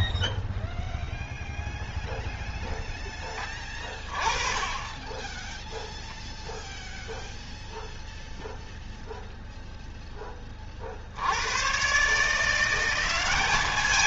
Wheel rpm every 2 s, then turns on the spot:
0, 10, 20, 0, 0, 60, 190.
none